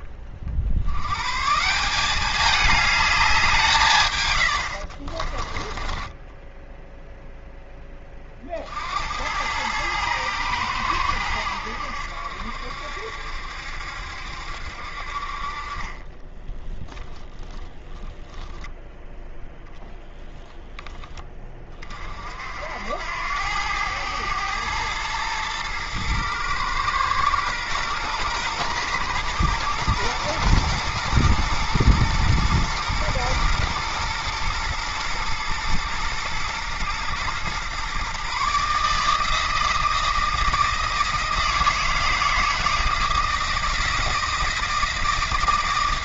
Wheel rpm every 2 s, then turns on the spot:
80, 210, 60, 0, 70, 100, 70, 60, 10, 0, 10, 80, 110, 110, 110, 120, 120, 110, 120, 150, 160, 160, 160.
4-6 16-18